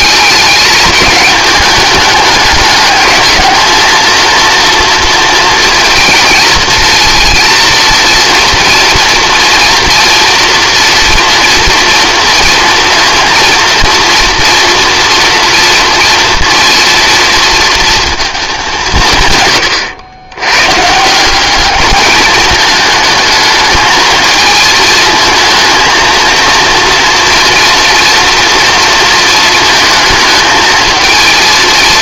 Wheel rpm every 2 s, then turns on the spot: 210, 210, 230, 230, 230, 230, 230, 230, 230, 200, 130, 210, 220, 230, 230, 220.
none